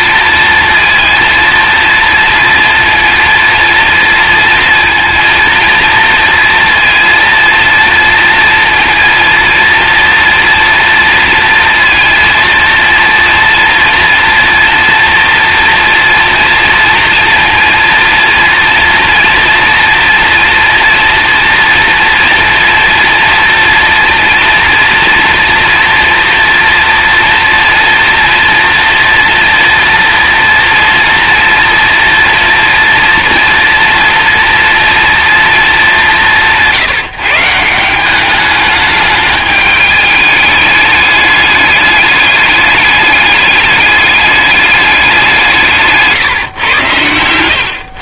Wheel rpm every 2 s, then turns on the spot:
230, 230, 230, 230, 230, 230, 230, 240, 230, 230, 230, 230, 230, 230, 230, 230, 230, 230, 170, 210, 210, 210, 200, 120.
46-48